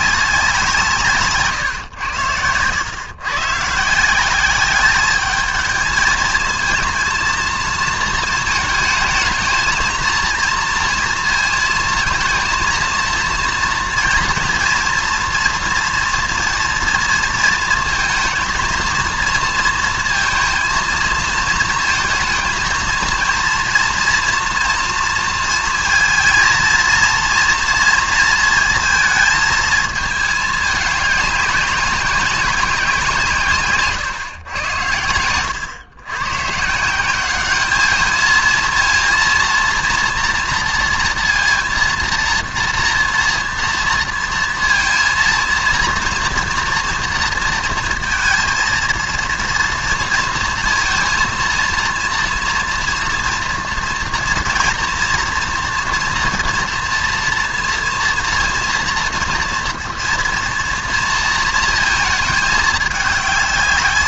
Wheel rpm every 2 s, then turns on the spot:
170, 100, 210, 230, 220, 230, 230, 230, 240, 230, 230, 230, 230, 230, 220, 200, 170, 100, 170, 230, 230, 230, 230, 230, 230, 230, 230, 230, 230, 230, 230, 210.
none